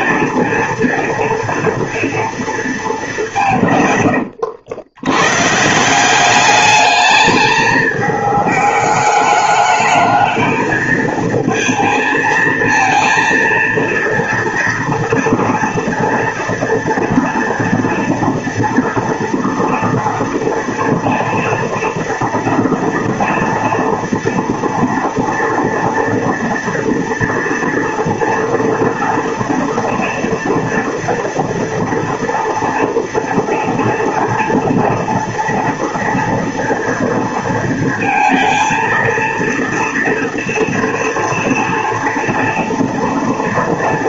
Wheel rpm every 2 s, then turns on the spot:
230, 220, 100, 210, 210, 220, 230, 230, 230, 230, 230, 240, 230, 230, 230, 230, 230, 230, 230, 230, 230, 230.
none